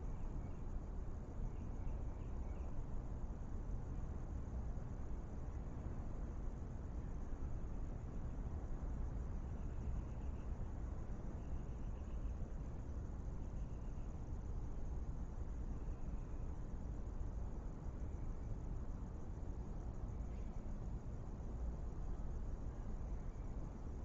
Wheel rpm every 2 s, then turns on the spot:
0, 0, 0, 0, 0, 0, 0, 0, 0, 0, 0, 0.
none